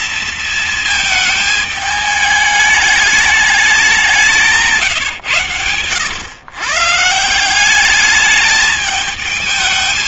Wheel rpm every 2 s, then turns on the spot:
230, 210, 170, 120, 210.
4-6